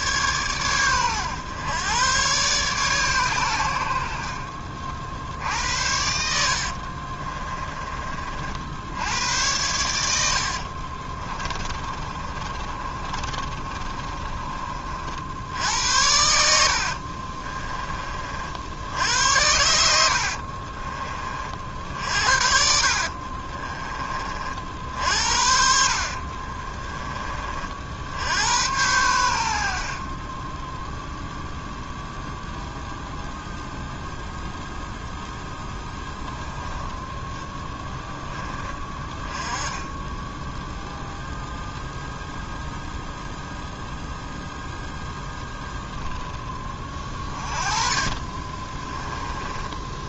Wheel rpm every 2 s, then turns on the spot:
120, 130, 50, 60, 60, 60, 30, 30, 70, 60, 40, 50, 50, 30, 90, 10, 0, 0, 10, 20, 0, 0, 0, 20, 20.
4-8 10-14 16-18 20-24 26-28 48-50